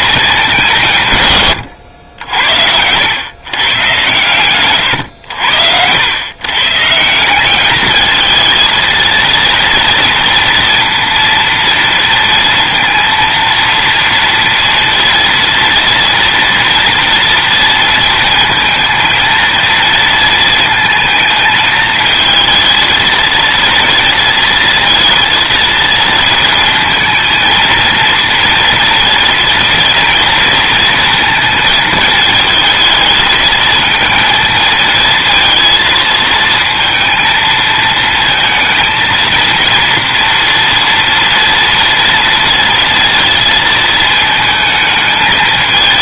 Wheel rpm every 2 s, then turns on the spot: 170, 90, 110, 140, 230, 240, 230, 230, 230, 230, 220, 220, 230, 230, 230, 230, 220, 230, 230, 230, 230, 230, 220.
none